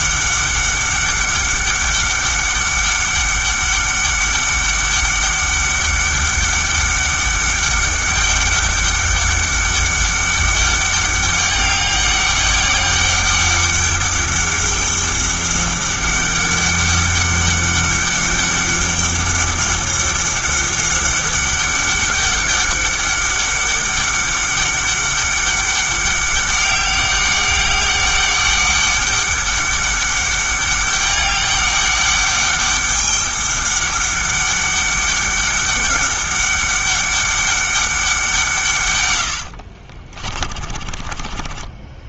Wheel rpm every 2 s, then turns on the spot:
200, 200, 200, 200, 200, 200, 200, 200, 200, 200, 200, 200, 200, 200, 200, 200, 200, 200, 200, 150, 40.
40-42